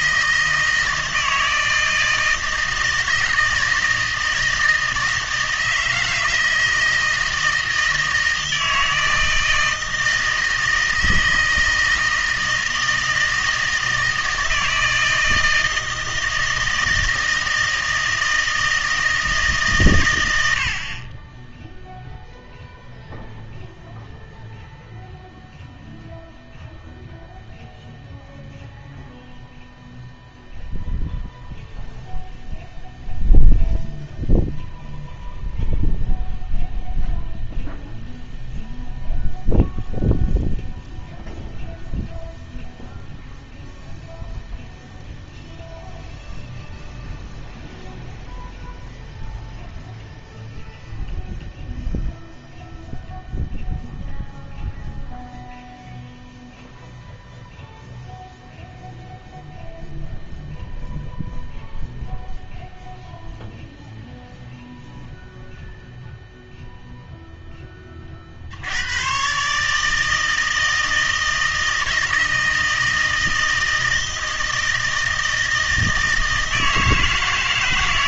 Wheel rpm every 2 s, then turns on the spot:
160, 160, 160, 160, 160, 160, 160, 160, 160, 160, 60, 0, 0, 0, 0, 0, 0, 0, 0, 0, 0, 0, 0, 0, 0, 0, 0, 0, 0, 0, 0, 0, 0, 0, 80, 160, 160, 160, 160.
none